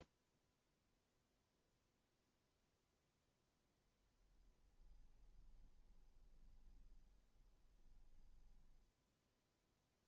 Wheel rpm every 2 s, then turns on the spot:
0, 0, 10, 20, 10.
4-10